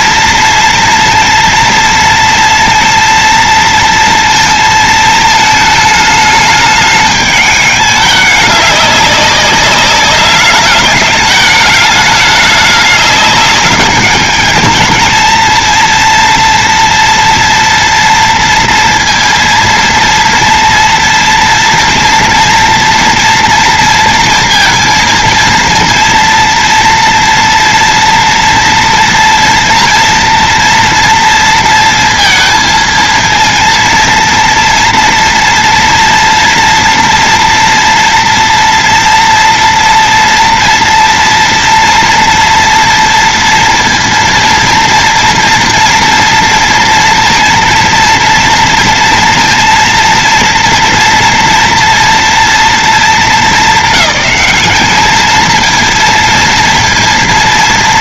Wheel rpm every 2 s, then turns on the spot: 230, 230, 230, 210, 200, 200, 210, 210, 230, 230, 230, 230, 230, 230, 230, 230, 230, 230, 240, 240, 230, 230, 230, 230, 230, 230, 230, 210, 230.
none